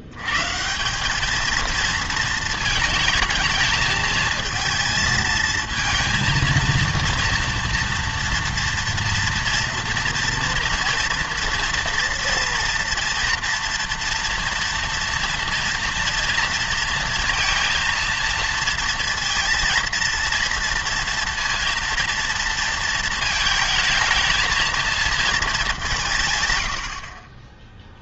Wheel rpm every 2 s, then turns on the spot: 160, 220, 220, 230, 240, 230, 230, 230, 230, 230, 230, 230, 220, 90.
none